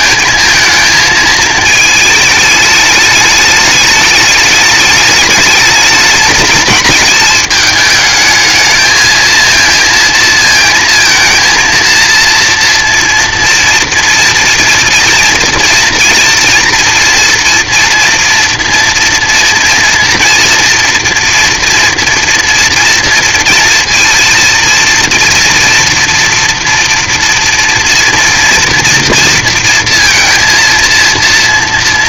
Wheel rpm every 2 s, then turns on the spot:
220, 220, 210, 220, 220, 230, 240, 230, 230, 230, 240, 230, 230, 230, 230, 230.
none